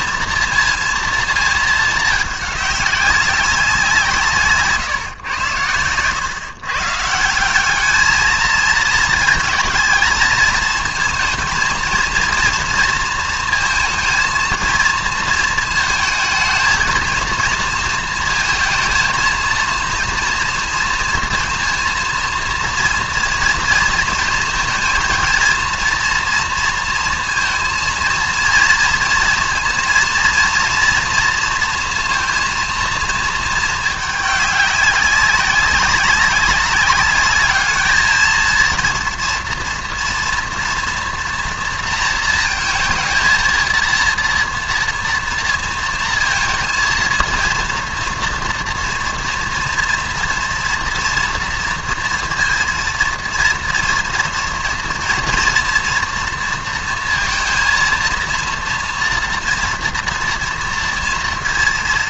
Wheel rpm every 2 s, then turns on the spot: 230, 200, 140, 130, 220, 220, 230, 230, 220, 220, 230, 230, 230, 230, 230, 230, 230, 200, 200, 230, 230, 220, 230, 230, 230, 230, 230, 230, 230, 230, 230.
4-6